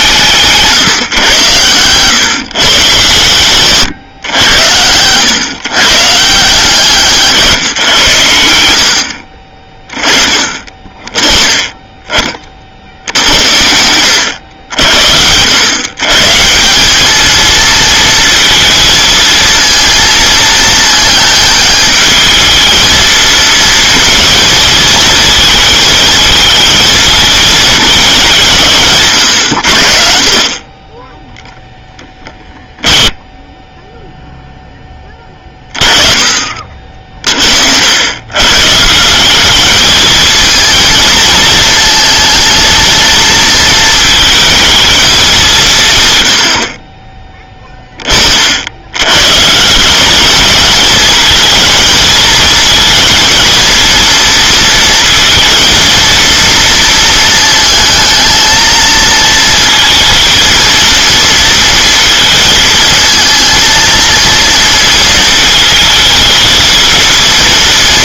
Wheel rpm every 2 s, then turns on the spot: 160, 140, 100, 160, 70, 30, 50, 80, 170, 220, 220, 220, 220, 220, 150, 30, 10, 0, 40, 140, 220, 230, 220, 50, 70, 220, 220, 230, 230, 220, 230, 230, 230, 220.
30-34